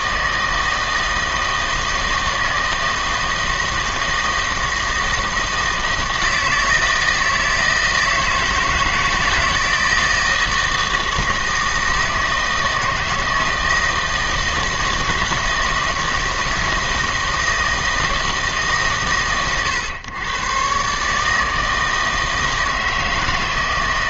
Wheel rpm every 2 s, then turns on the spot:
160, 160, 160, 160, 170, 160, 160, 160, 160, 140, 140, 160.
none